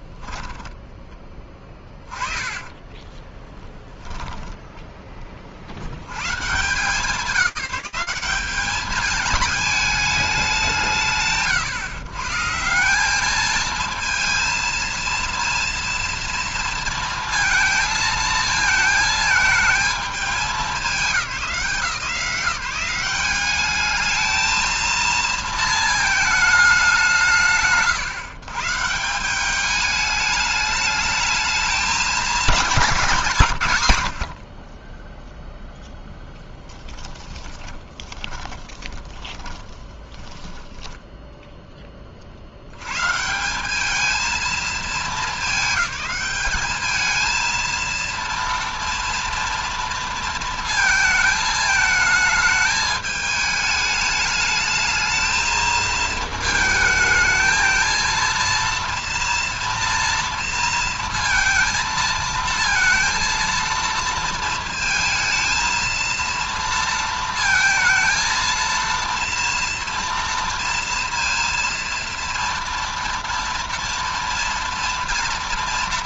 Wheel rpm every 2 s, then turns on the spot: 10, 20, 10, 160, 210, 170, 190, 230, 230, 220, 190, 190, 230, 190, 160, 210, 190, 30, 10, 20, 10, 90, 220, 210, 230, 230, 220, 210, 220, 230, 230, 230, 230, 230, 230, 230, 230, 230.
0-4 34-42